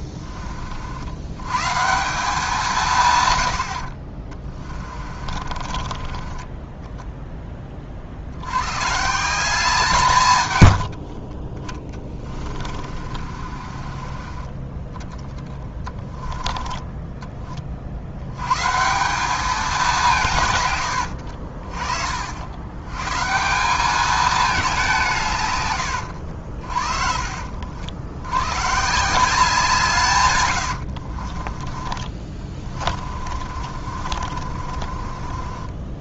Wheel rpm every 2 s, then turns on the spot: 60, 160, 30, 10, 130, 60, 40, 20, 20, 170, 100, 120, 180, 50, 150, 70, 30, 40.
4-8 10-14 16-18 20-22 30-36